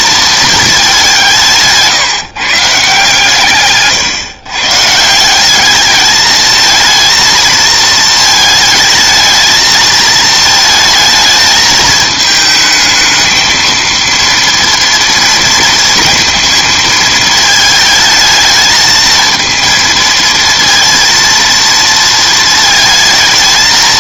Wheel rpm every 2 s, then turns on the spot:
220, 150, 130, 220, 220, 220, 220, 230, 230, 220, 230, 230.
none